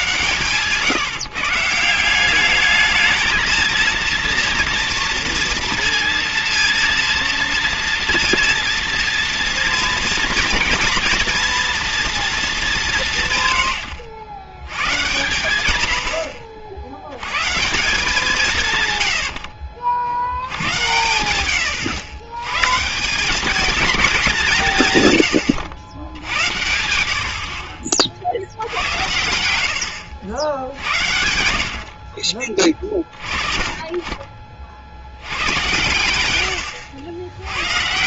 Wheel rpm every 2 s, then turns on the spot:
140, 200, 230, 230, 230, 230, 210, 90, 70, 140, 90, 130, 160, 80, 70, 80, 30, 50, 90.
0-2